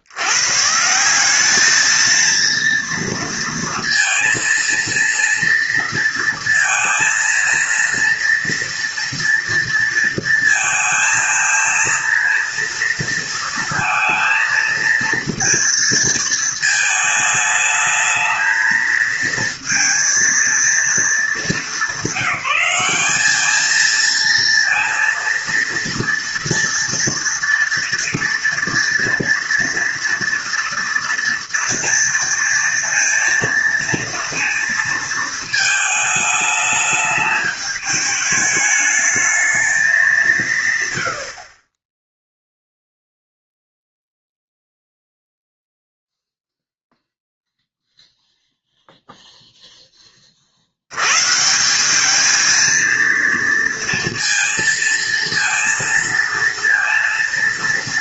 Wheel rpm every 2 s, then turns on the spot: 160, 230, 230, 230, 230, 230, 230, 230, 220, 220, 220, 200, 230, 230, 230, 230, 230, 230, 210, 210, 120, 0, 0, 0, 0, 80, 230, 230, 230.
none